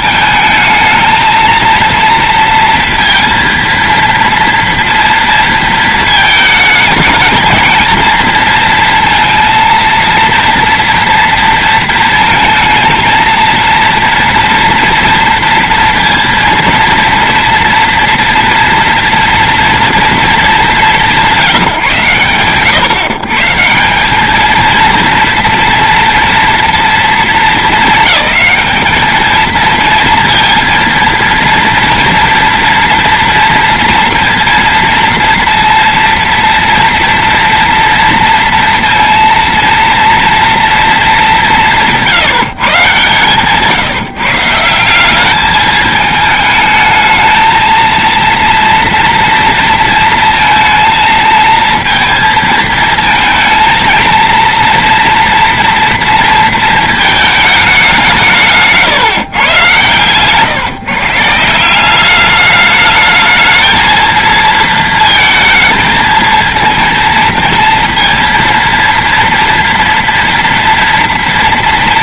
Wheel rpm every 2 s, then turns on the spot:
220, 230, 230, 220, 230, 230, 220, 230, 230, 230, 200, 110, 220, 240, 210, 230, 230, 230, 230, 230, 230, 140, 160, 220, 230, 230, 220, 230, 230, 150, 140, 210, 230, 230, 230, 240.
none